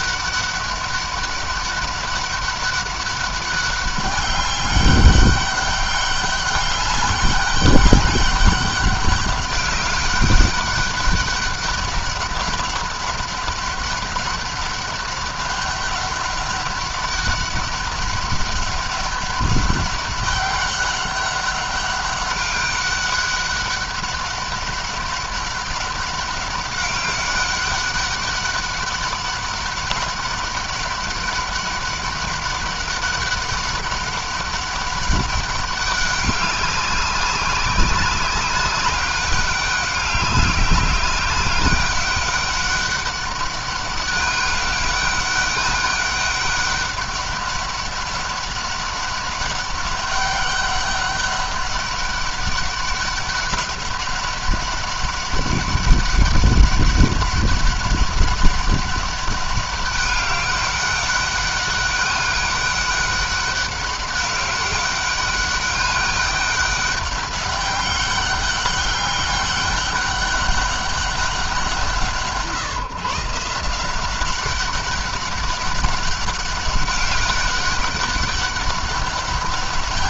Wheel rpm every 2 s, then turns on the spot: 200, 200, 200, 200, 200, 200, 200, 200, 200, 200, 190, 200, 200, 200, 200, 200, 200, 200, 200, 190, 200, 200, 200, 200, 200, 200, 200, 200, 200, 200, 200, 200, 200, 200, 200, 200, 150, 190, 200, 200.
none